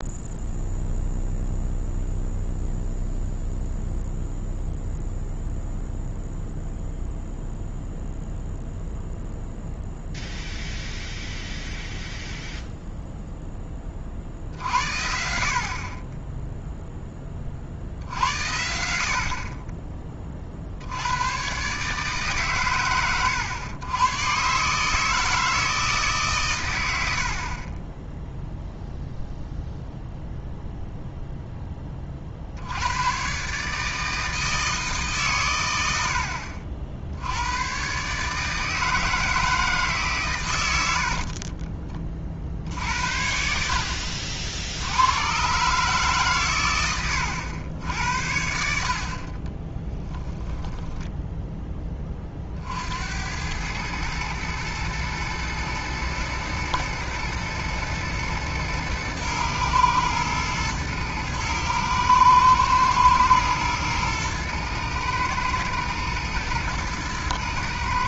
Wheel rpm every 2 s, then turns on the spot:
0, 0, 0, 0, 0, 0, 0, 70, 0, 70, 70, 120, 140, 140, 0, 0, 80, 160, 60, 160, 90, 60, 80, 110, 70, 10, 60, 110, 120, 110, 110, 120, 110, 110.
50-52